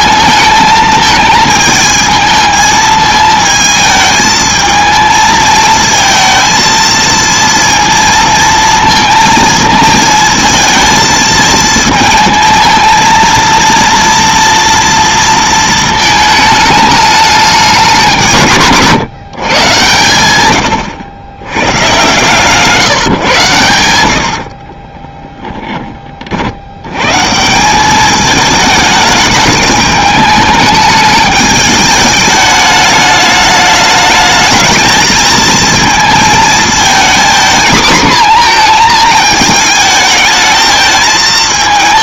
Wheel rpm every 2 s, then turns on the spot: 220, 220, 220, 230, 230, 220, 220, 230, 210, 150, 100, 150, 40, 80, 210, 210, 210, 220, 220, 230, 220.
24-26